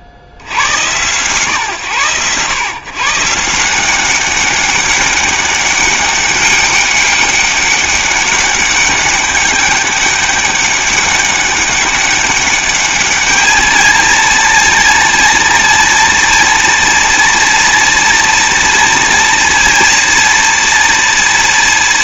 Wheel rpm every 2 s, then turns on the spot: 90, 130, 190, 200, 200, 200, 200, 230, 230, 230, 240.
none